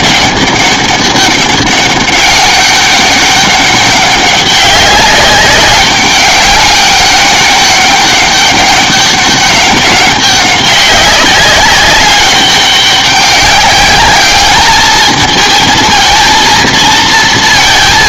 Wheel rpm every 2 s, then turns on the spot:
200, 190, 190, 200, 200, 200, 200, 210, 230.
none